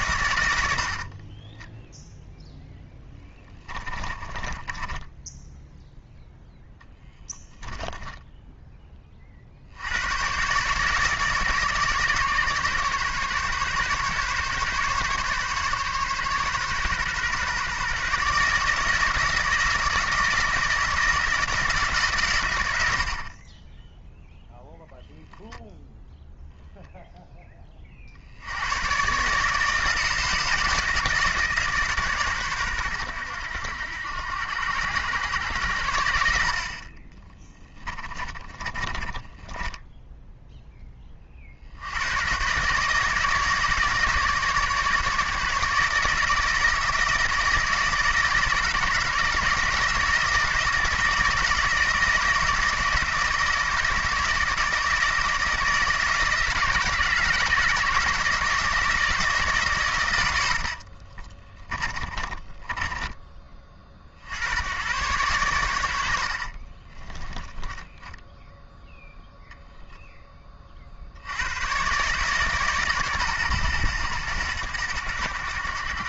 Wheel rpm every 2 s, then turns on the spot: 80, 0, 20, 0, 10, 140, 140, 140, 130, 160, 160, 90, 0, 0, 90, 160, 120, 90, 60, 30, 10, 140, 150, 160, 160, 170, 160, 160, 160, 160, 80, 30, 90, 40, 0, 30, 140, 100.
0-2 4-6 38-40 60-64 66-68